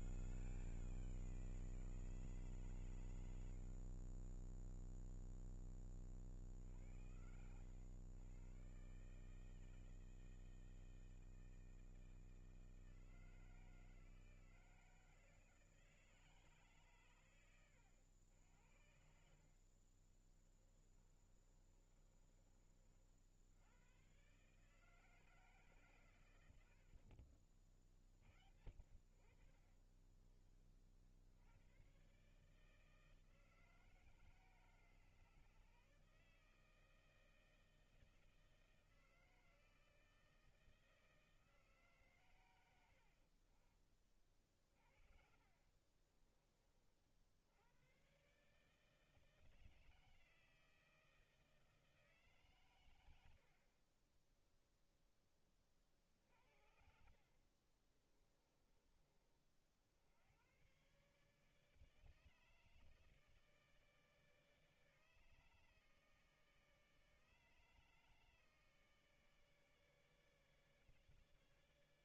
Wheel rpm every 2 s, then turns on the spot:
170, 50, 20, 90, 160, 160, 160, 160, 90, 40, 30, 100, 150, 70, 40, 110, 160, 150, 160, 160, 150, 50, 40, 100, 160, 160, 40, 40, 40, 60, 150, 150, 150, 150, 150, 150.
18-22 28-30 44-46 52-54 56-58